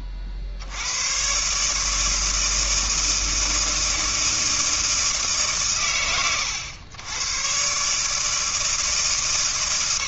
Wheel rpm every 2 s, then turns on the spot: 80, 160, 160, 110, 150.
none